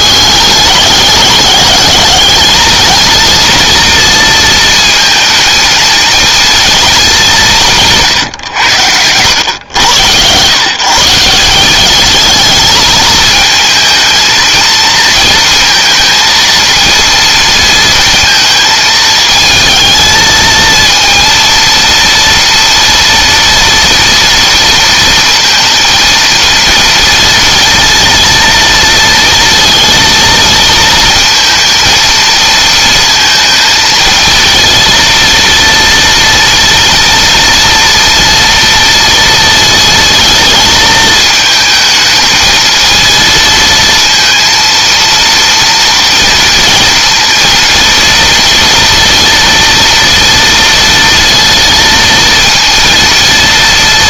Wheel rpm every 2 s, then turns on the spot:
200, 230, 230, 210, 100, 150, 220, 230, 230, 220, 230, 230, 230, 230, 230, 230, 230, 230, 230, 230, 220, 220, 230, 230, 240, 230, 230.
none